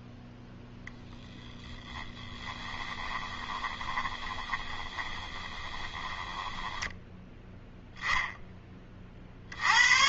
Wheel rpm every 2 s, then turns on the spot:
0, 20, 20, 10, 30.
2-8